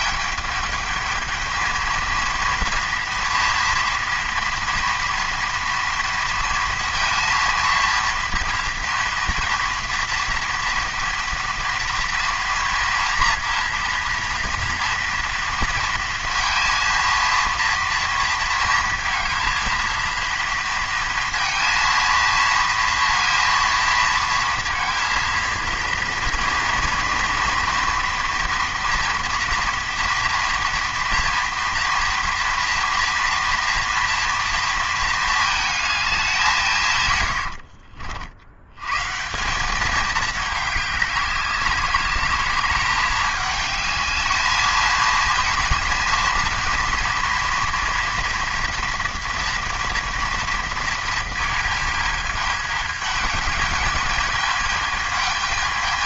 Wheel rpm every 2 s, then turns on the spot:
210, 230, 230, 230, 230, 230, 230, 230, 230, 230, 230, 230, 230, 230, 230, 230, 230, 230, 140, 120, 200, 210, 220, 230, 240, 230, 210, 210.
none